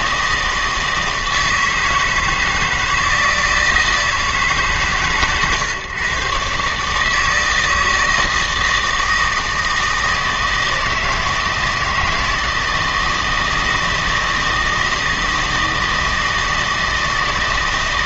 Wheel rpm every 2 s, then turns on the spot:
160, 160, 150, 140, 160, 160, 160, 160, 160.
none